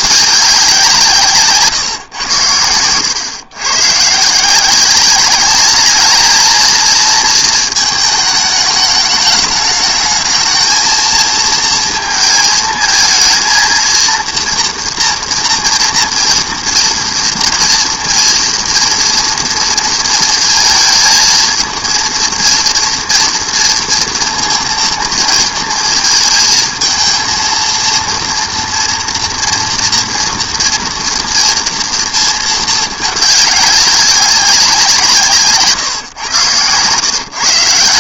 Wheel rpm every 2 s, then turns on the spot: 190, 100, 180, 220, 210, 220, 220, 230, 230, 230, 230, 230, 230, 220, 230, 230, 220, 190, 120.
none